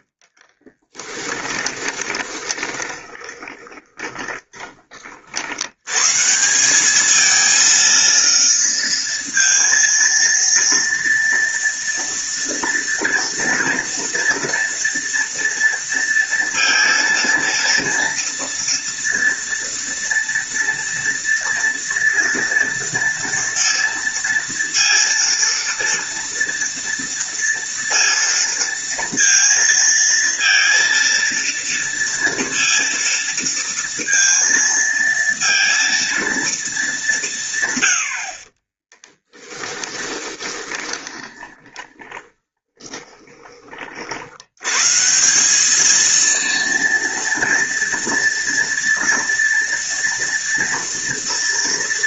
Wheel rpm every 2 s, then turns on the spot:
20, 20, 60, 230, 230, 230, 230, 230, 230, 230, 230, 230, 230, 230, 230, 230, 230, 230, 160, 10, 10, 20, 180, 230, 230, 230.
0-4 38-42